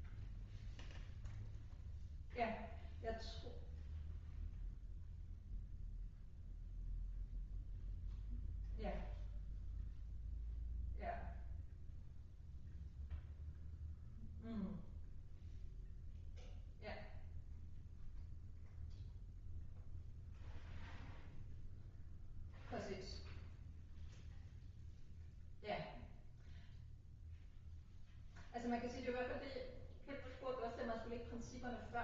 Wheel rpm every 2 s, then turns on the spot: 0, 0, 0, 0, 0, 0, 0, 0, 0, 0, 0, 0, 0, 0, 0, 0.
none